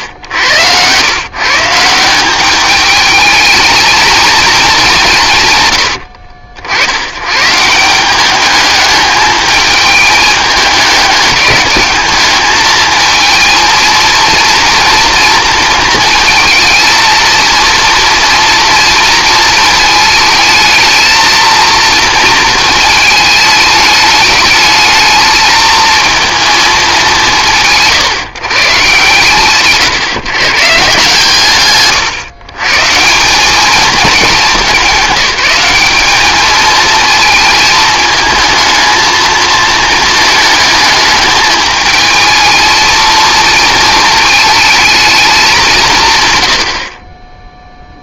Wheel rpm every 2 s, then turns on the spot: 100, 210, 200, 80, 210, 210, 220, 230, 220, 230, 220, 220, 210, 220, 140, 150, 140, 210, 220, 220, 210, 220, 220, 60.
none